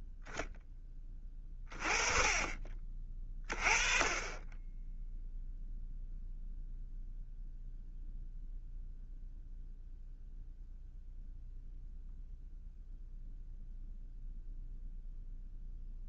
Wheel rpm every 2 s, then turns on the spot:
10, 30, 10, 0, 0, 0, 0, 0.
none